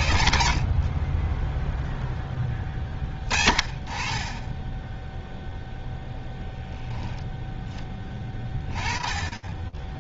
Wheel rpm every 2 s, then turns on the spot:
40, 20, 0, 0, 20.
none